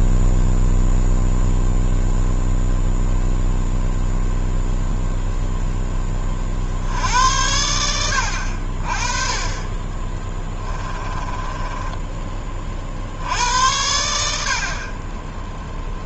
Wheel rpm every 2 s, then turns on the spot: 0, 0, 0, 60, 50, 20, 40, 50.
10-12